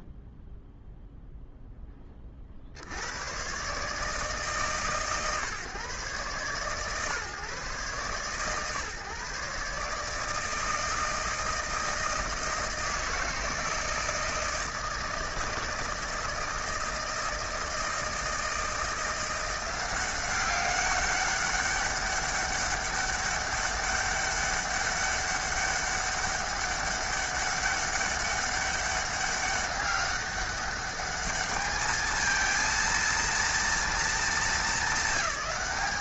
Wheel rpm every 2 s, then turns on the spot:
0, 20, 140, 130, 140, 160, 160, 160, 160, 170, 200, 200, 200, 200, 200, 200, 230, 220.
none